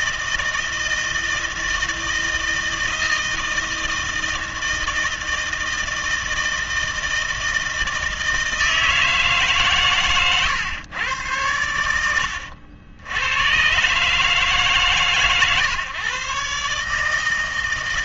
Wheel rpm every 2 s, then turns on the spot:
160, 160, 160, 160, 160, 120, 80, 140, 150.
none